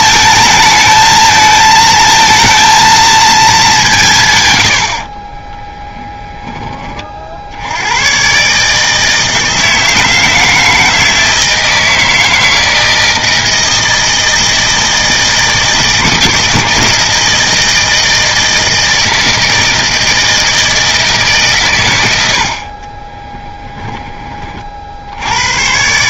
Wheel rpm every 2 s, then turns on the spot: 220, 230, 110, 20, 140, 160, 160, 160, 160, 160, 160, 50, 40.
none